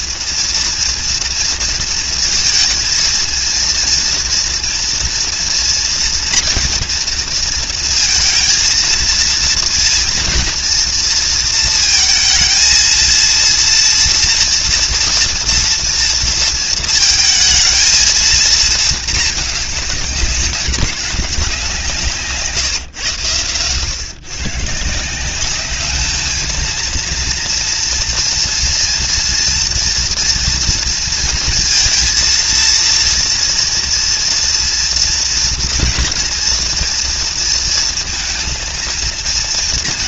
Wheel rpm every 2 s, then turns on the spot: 230, 230, 230, 230, 230, 230, 230, 230, 230, 220, 200, 140, 160, 230, 240, 230, 230, 240, 230, 230.
none